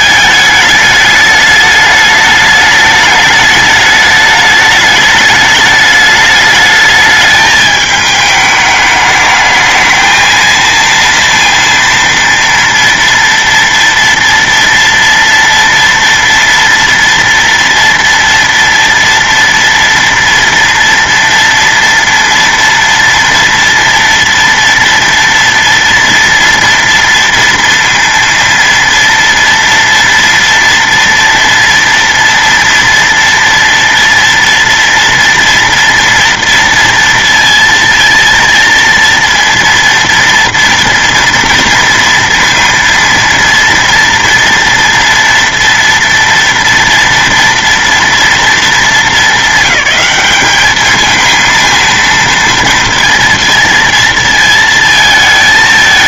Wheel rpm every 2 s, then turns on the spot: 210, 210, 210, 210, 210, 230, 230, 230, 230, 230, 240, 230, 230, 230, 230, 230, 230, 230, 230, 230, 230, 230, 230, 230, 220, 210, 230, 230.
none